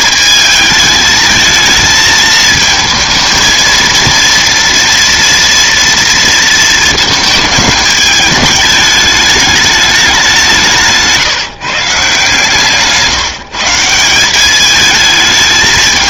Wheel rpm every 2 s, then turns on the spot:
220, 220, 240, 220, 210, 150, 150, 220.
10-12